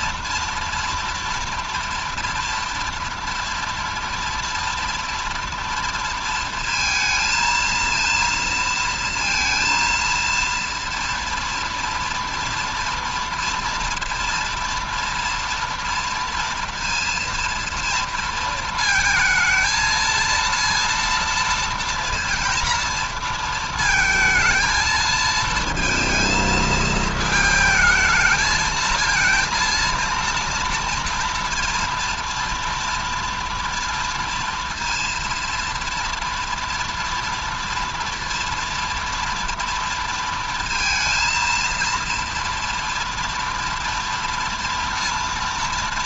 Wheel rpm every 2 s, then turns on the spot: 240, 240, 230, 230, 230, 230, 230, 230, 230, 230, 230, 230, 230, 220, 220, 230, 230, 230, 230, 240, 230, 230, 230.
none